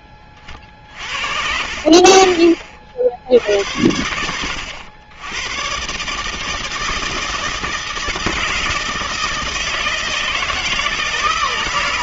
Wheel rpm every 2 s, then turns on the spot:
40, 50, 90, 160, 160, 160.
none